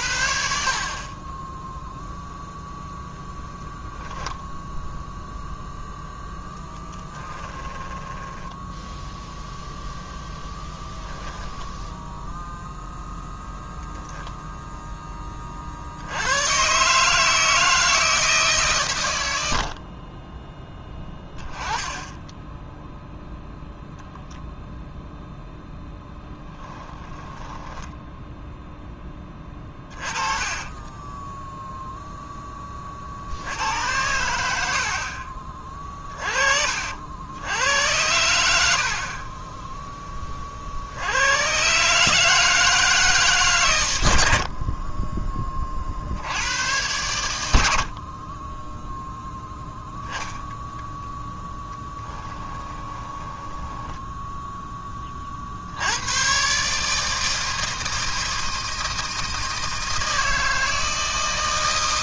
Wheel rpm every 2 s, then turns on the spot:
40, 0, 0, 10, 10, 0, 0, 0, 130, 130, 10, 0, 0, 10, 10, 20, 10, 80, 50, 70, 60, 160, 50, 100, 10, 10, 10, 10, 140, 160, 160.
6-10 26-28 30-32 52-54